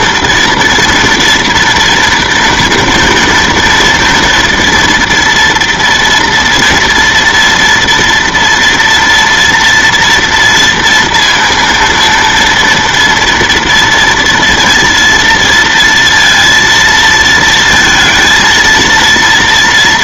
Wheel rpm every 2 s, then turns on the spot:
230, 230, 240, 230, 230, 230, 230, 230, 230, 230.
none